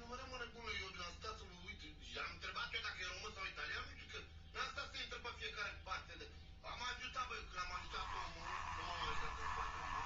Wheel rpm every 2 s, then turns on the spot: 0, 0, 0, 0, 20.
8-10